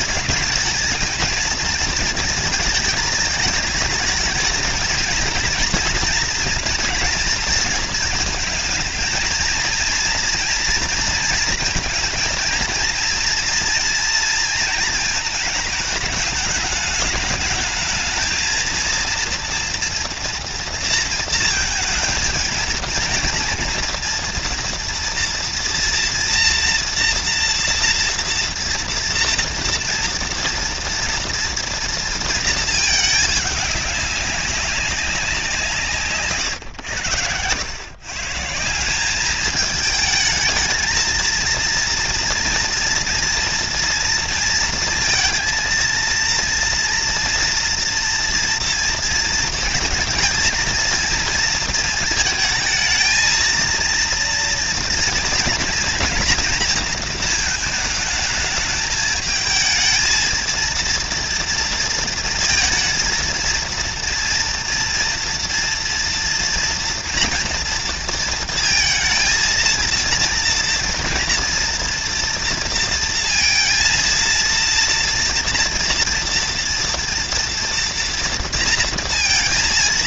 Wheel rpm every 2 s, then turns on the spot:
220, 220, 220, 230, 220, 230, 230, 220, 210, 220, 230, 230, 230, 230, 230, 230, 220, 190, 100, 190, 220, 230, 230, 240, 230, 230, 230, 240, 230, 220, 230, 230, 230, 230, 230, 230, 230, 230, 230, 230.
none